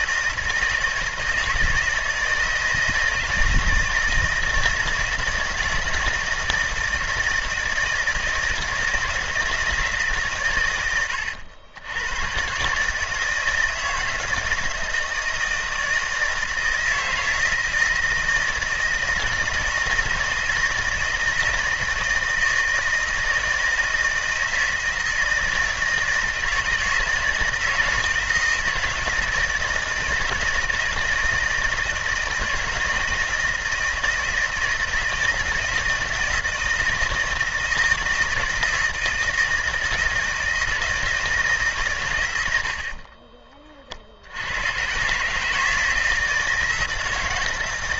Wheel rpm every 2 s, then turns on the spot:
160, 160, 160, 160, 160, 100, 150, 160, 160, 160, 160, 160, 160, 170, 160, 160, 160, 160, 160, 160, 160, 50, 120, 160.
42-44